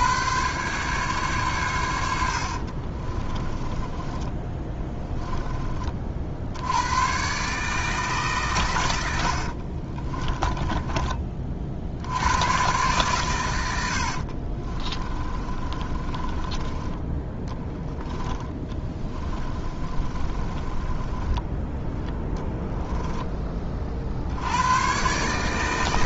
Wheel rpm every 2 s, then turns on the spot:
140, 50, 10, 90, 110, 20, 120, 30, 20, 20, 30, 10, 100.
2-6 14-24